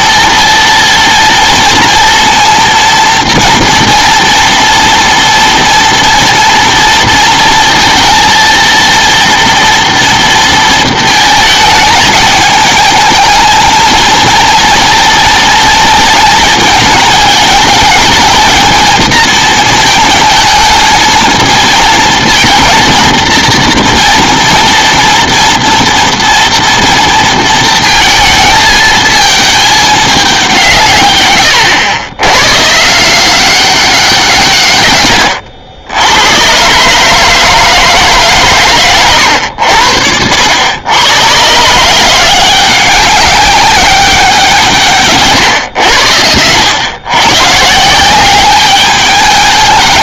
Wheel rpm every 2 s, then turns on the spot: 230, 230, 230, 230, 230, 230, 220, 230, 220, 220, 220, 230, 230, 230, 220, 180, 130, 140, 120, 140, 80, 180, 170, 100, 200.
none